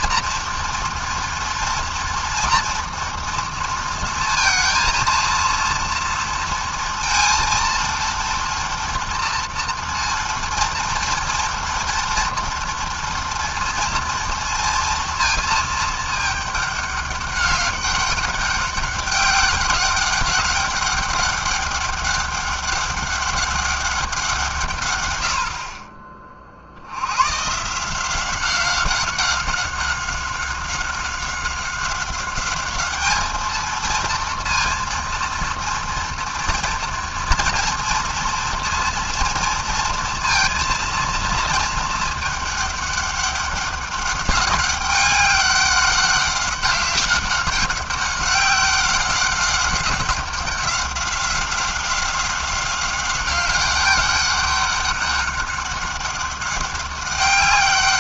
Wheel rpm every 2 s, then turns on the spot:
230, 230, 230, 230, 230, 230, 240, 230, 200, 200, 200, 200, 90, 110, 190, 190, 220, 230, 230, 230, 220, 200, 200, 190, 190, 190, 200, 200, 190.
none